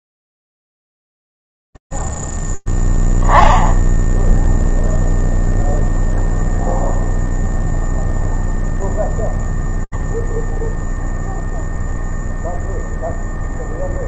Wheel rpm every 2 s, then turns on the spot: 0, 0, 10, 0, 0, 0, 0.
none